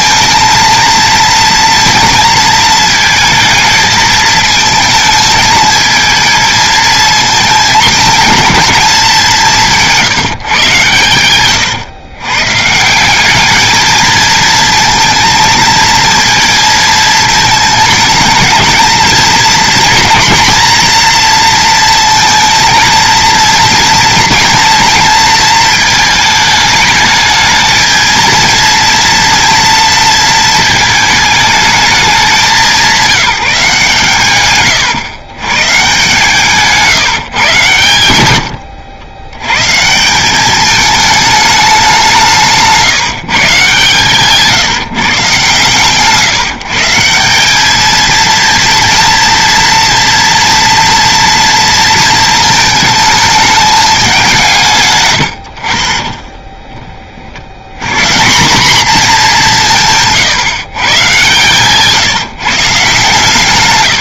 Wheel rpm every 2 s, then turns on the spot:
230, 230, 220, 220, 230, 140, 140, 230, 230, 220, 230, 230, 230, 220, 230, 230, 190, 120, 150, 80, 210, 160, 150, 150, 230, 230, 220, 160, 20, 210, 140, 150.
36-40 42-44